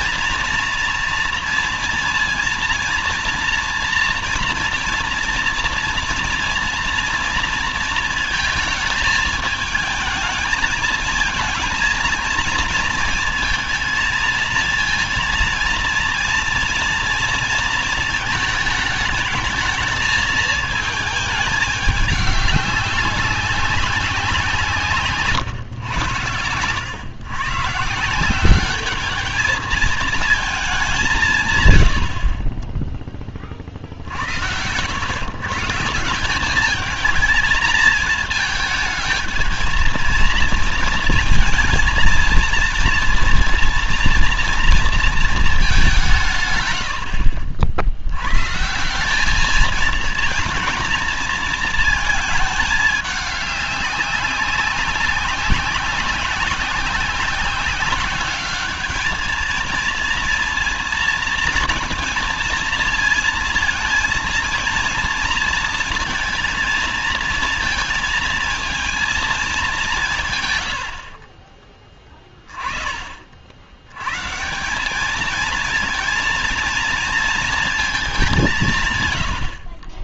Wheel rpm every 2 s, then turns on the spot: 230, 230, 230, 230, 220, 220, 230, 230, 230, 220, 220, 200, 170, 110, 190, 210, 20, 110, 210, 220, 230, 230, 230, 120, 150, 230, 210, 190, 190, 200, 230, 230, 230, 230, 230, 120, 20, 170, 230, 200.
none